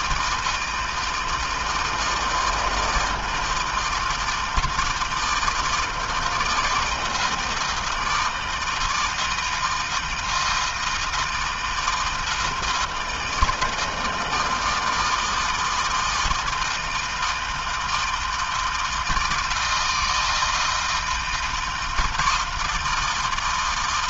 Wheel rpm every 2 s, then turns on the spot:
160, 160, 160, 160, 160, 160, 170, 160, 160, 160, 160, 160.
none